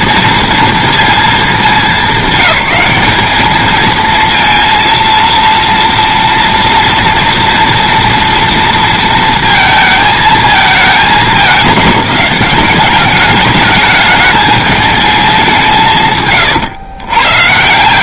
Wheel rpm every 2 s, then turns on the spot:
230, 210, 230, 230, 230, 220, 200, 220, 120.
none